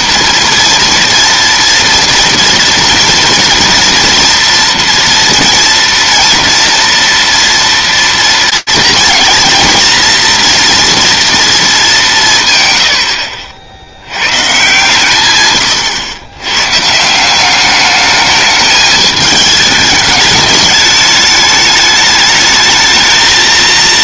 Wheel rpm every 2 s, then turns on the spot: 230, 230, 230, 230, 230, 230, 140, 130, 120, 210, 210, 210.
none